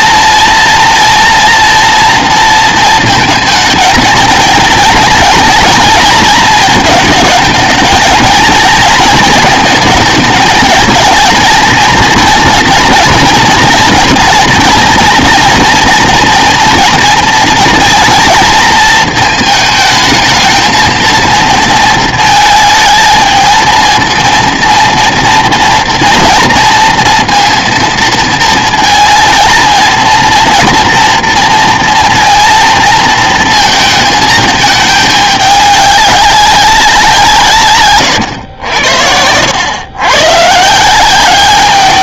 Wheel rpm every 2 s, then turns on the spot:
230, 230, 230, 220, 230, 220, 230, 230, 230, 230, 220, 220, 230, 230, 230, 230, 230, 220, 190, 80, 150.
none